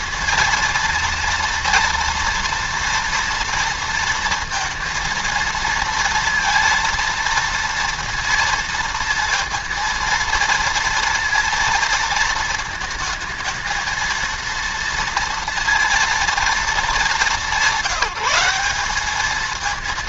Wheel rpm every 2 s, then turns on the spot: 230, 230, 230, 230, 230, 230, 220, 230, 220, 200.
none